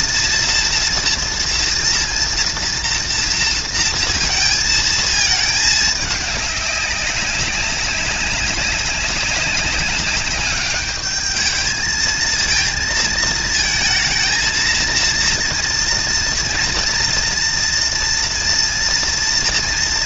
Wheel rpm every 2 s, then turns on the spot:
230, 230, 220, 200, 190, 200, 230, 230, 230, 240.
none